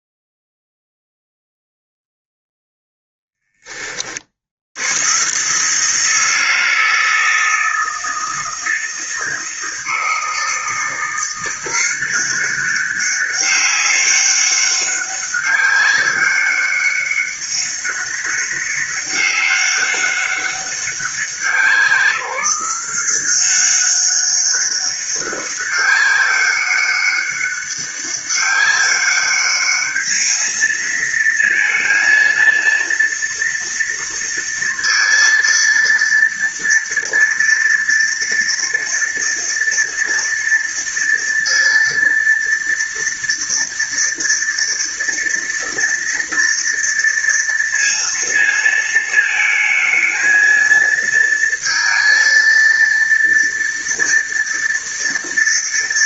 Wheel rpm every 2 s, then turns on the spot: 0, 0, 80, 160, 160, 170, 190, 200, 200, 200, 190, 170, 200, 200, 200, 220, 230, 230, 230, 230, 230, 230, 230, 230, 220, 220, 230, 230.
none